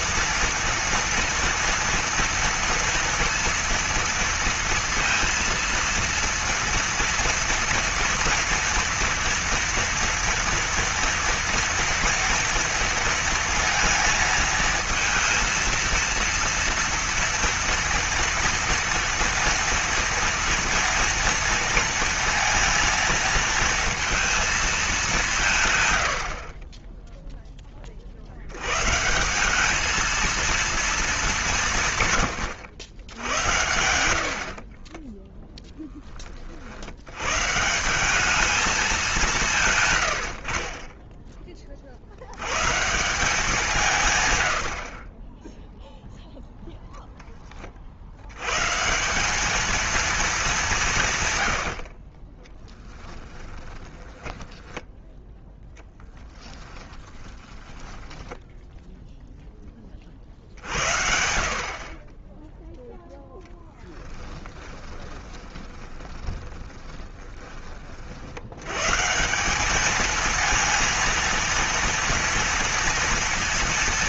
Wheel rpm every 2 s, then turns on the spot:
230, 230, 230, 240, 240, 230, 230, 230, 230, 230, 230, 230, 220, 20, 120, 220, 100, 40, 70, 210, 40, 130, 80, 0, 140, 180, 20, 10, 10, 0, 70, 10, 20, 30, 120, 230, 230.
52-58 64-68